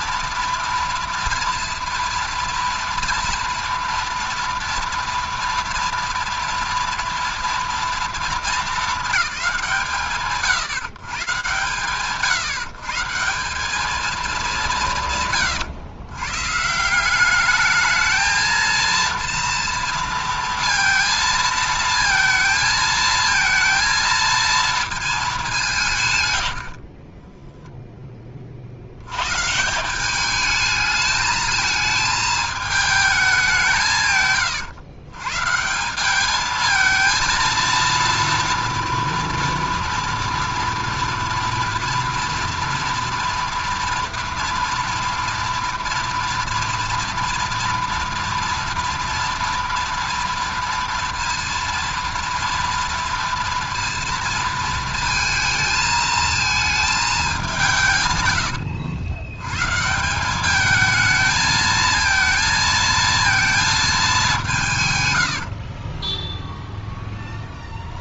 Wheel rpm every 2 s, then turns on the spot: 230, 230, 230, 230, 220, 150, 150, 180, 160, 230, 230, 230, 230, 60, 80, 220, 210, 120, 220, 230, 230, 230, 230, 240, 230, 230, 230, 230, 220, 80, 210, 230, 150, 0.
26-28